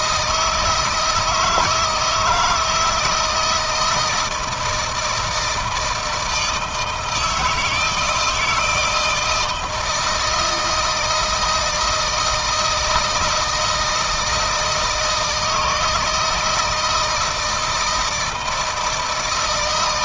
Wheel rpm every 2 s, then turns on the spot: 160, 160, 160, 160, 160, 170, 160, 160, 160, 160.
none